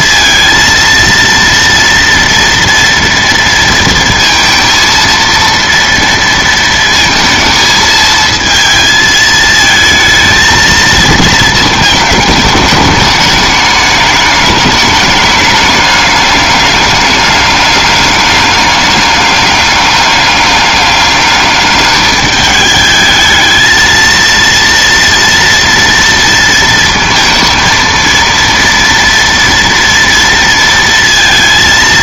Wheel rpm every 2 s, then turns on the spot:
230, 230, 230, 230, 230, 220, 210, 210, 200, 200, 200, 210, 230, 230, 230, 230.
none